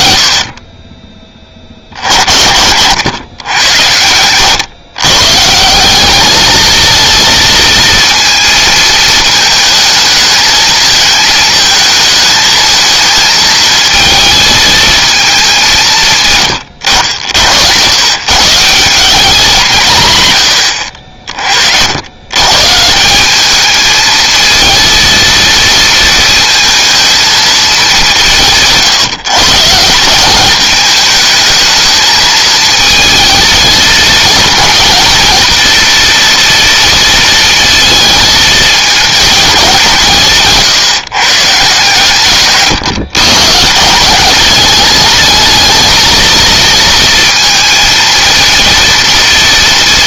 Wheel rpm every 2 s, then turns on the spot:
40, 50, 110, 220, 220, 220, 220, 220, 110, 150, 110, 130, 230, 230, 160, 210, 220, 220, 230, 220, 150, 130, 200, 220, 230.
none